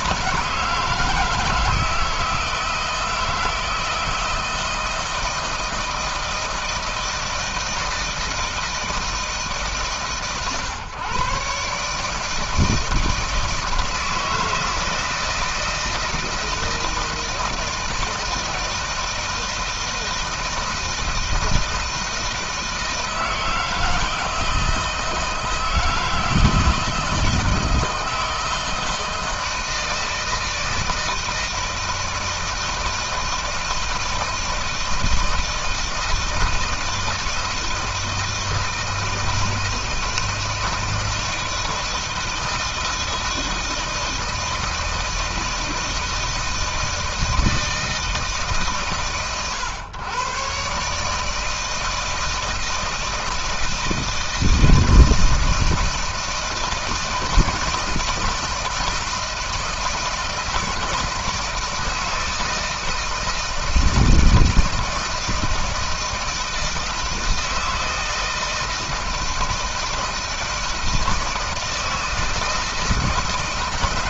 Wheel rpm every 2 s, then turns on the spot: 160, 160, 160, 160, 160, 130, 160, 160, 160, 160, 160, 160, 160, 170, 160, 160, 160, 160, 160, 160, 160, 160, 160, 160, 150, 140, 160, 160, 160, 160, 160, 160, 160, 160, 160, 160, 160.
none